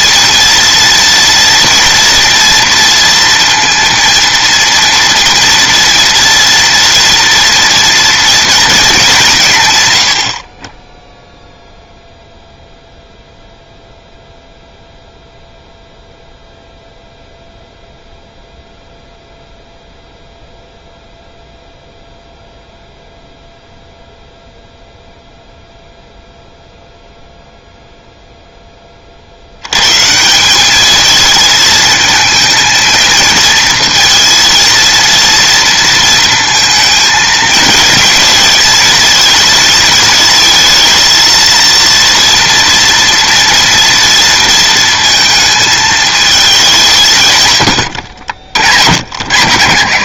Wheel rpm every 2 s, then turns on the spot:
240, 230, 230, 230, 210, 10, 0, 0, 0, 0, 0, 0, 0, 0, 30, 210, 220, 230, 220, 220, 230, 230, 230, 160, 90.
none